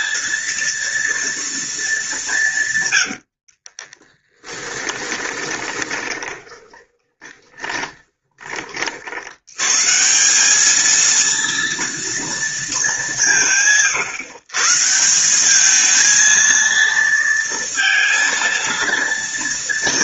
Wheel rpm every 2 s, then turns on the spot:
230, 140, 10, 20, 30, 200, 220, 140, 230, 230.
4-8